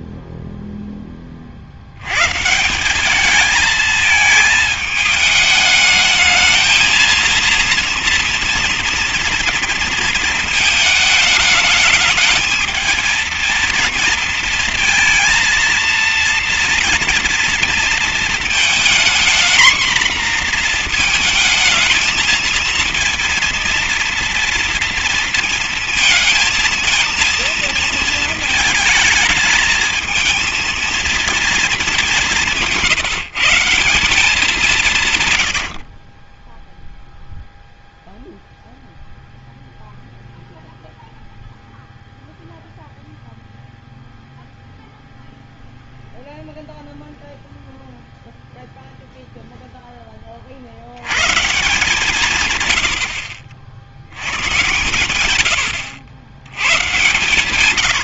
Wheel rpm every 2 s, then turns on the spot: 0, 140, 220, 220, 230, 230, 220, 230, 230, 230, 240, 230, 230, 230, 220, 220, 180, 180, 20, 0, 0, 0, 0, 0, 0, 50, 140, 120, 100.
36-38